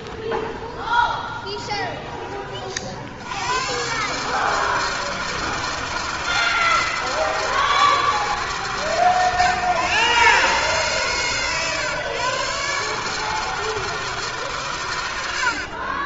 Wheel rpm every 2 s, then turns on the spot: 10, 40, 150, 160, 150, 130, 140, 120.
0-2